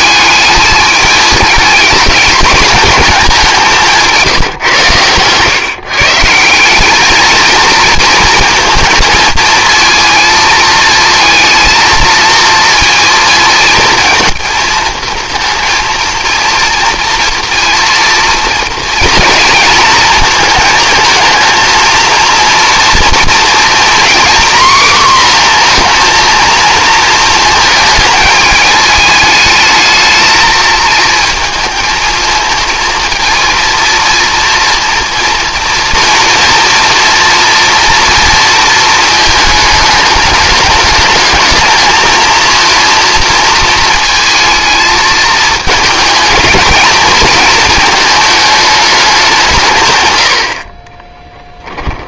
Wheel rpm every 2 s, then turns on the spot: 220, 220, 130, 190, 230, 220, 230, 230, 230, 230, 220, 240, 250, 230, 210, 220, 230, 230, 230, 230, 210, 230, 220, 220, 210, 50.
50-52